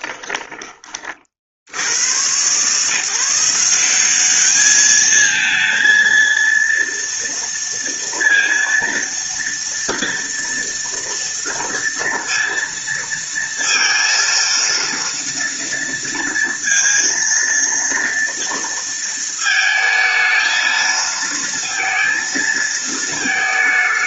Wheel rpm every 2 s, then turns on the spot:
40, 160, 220, 230, 230, 230, 230, 230, 230, 230, 230, 220.
none